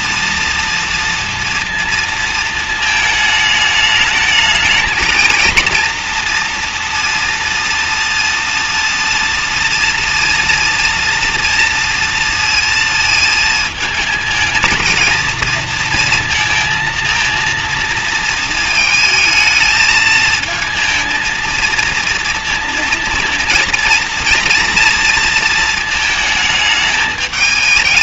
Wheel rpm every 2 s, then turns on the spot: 240, 220, 220, 230, 230, 230, 230, 220, 230, 220, 220, 230, 230, 220.
none